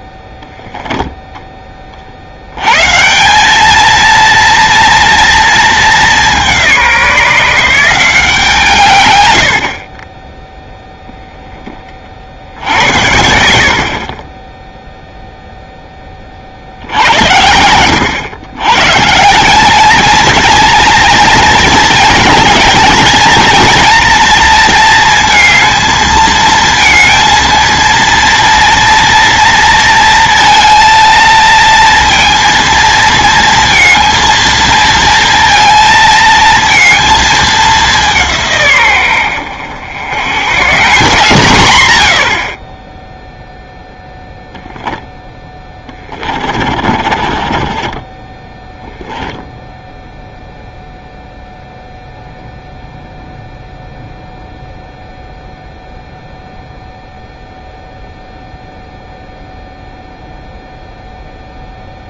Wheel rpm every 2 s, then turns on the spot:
10, 100, 230, 180, 160, 10, 70, 0, 60, 120, 230, 220, 230, 220, 230, 230, 230, 230, 220, 130, 130, 30, 10, 40, 10, 0, 0, 0, 0, 0, 0.
46-50